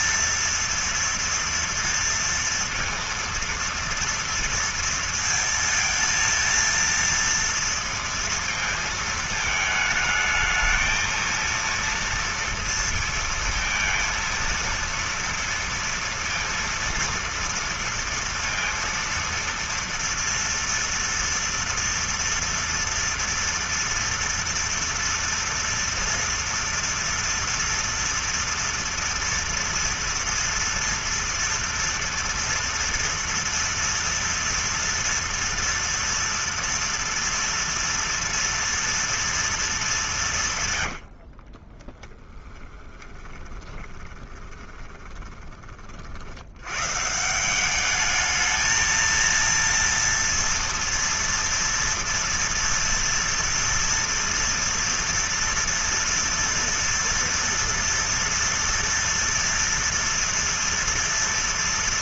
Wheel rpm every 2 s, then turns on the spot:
230, 230, 230, 230, 220, 220, 230, 230, 230, 230, 230, 230, 230, 230, 230, 230, 240, 240, 230, 230, 130, 10, 20, 110, 220, 230, 230, 240, 230, 230, 230.
40-46